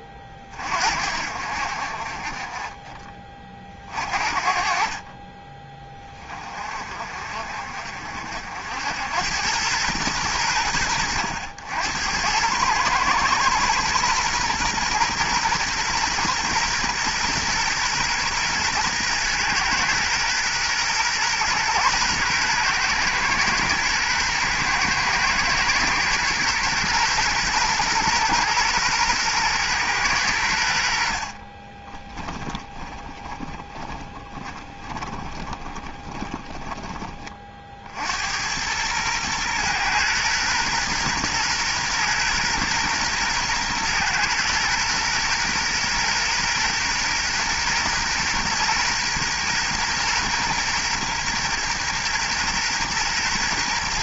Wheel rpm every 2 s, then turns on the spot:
50, 20, 40, 40, 70, 70, 110, 120, 120, 120, 120, 120, 120, 120, 120, 70, 10, 30, 30, 110, 120, 120, 120, 120, 120, 120, 120.
32-36